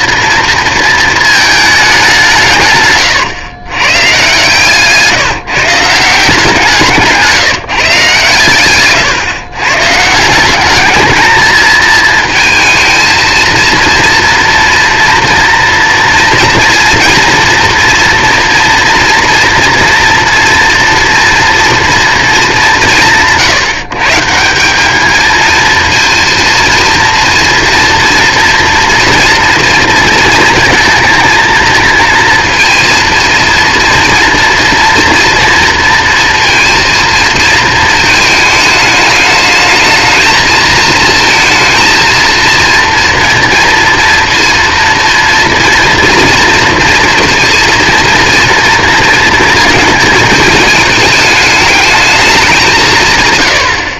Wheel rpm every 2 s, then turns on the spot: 230, 140, 150, 160, 120, 190, 230, 240, 230, 230, 240, 180, 190, 230, 230, 230, 230, 240, 230, 220, 220, 230, 230, 230, 230, 220, 180.
4-6 8-10